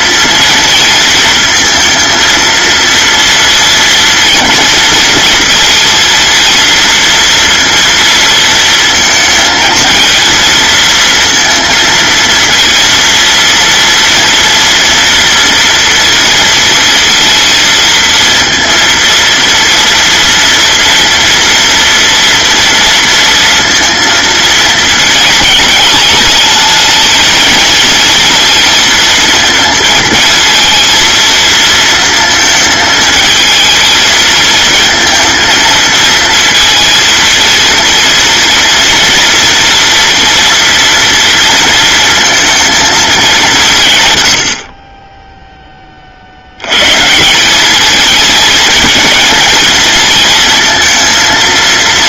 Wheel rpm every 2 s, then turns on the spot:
230, 230, 230, 230, 230, 230, 230, 230, 230, 230, 230, 230, 220, 220, 230, 230, 220, 230, 230, 230, 230, 220, 30, 160, 220, 230.
none